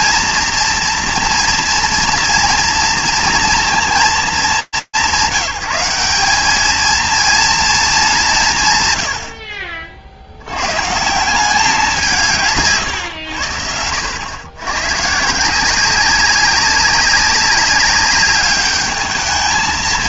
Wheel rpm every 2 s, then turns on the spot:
230, 230, 190, 210, 150, 120, 130, 120, 200, 210.
none